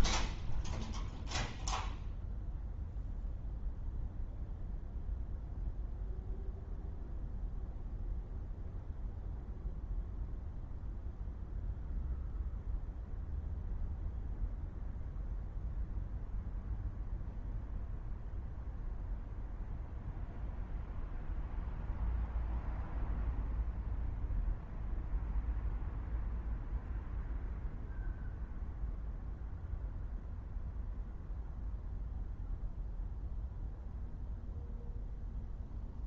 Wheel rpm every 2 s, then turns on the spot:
0, 0, 0, 0, 0, 0, 0, 0, 0, 0, 0, 0, 0, 0, 0, 0, 0, 0.
none